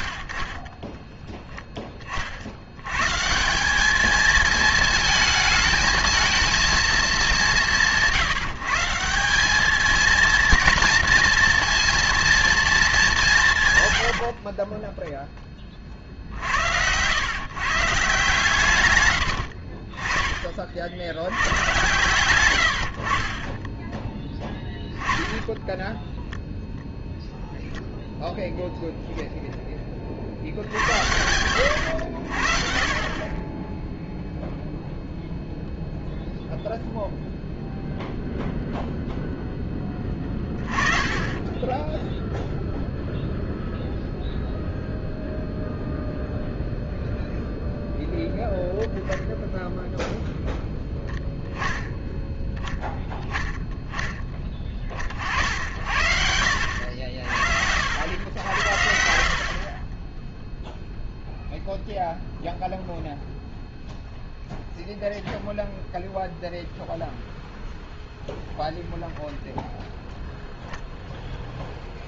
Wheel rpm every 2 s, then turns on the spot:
50, 80, 220, 220, 170, 230, 220, 30, 80, 130, 50, 90, 20, 0, 0, 70, 50, 0, 0, 0, 30, 0, 0, 0, 0, 0, 10, 20, 70, 80, 0, 0, 0, 0, 0, 0.
14-16 24-26 32-34